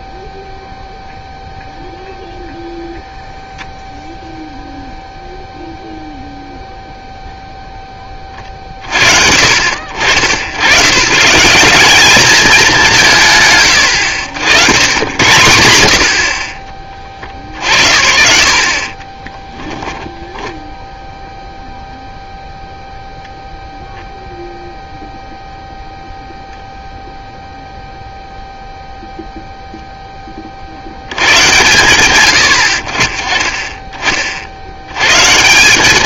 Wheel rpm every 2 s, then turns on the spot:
0, 0, 0, 0, 40, 90, 210, 100, 40, 60, 10, 0, 0, 0, 0, 20, 80, 70.
none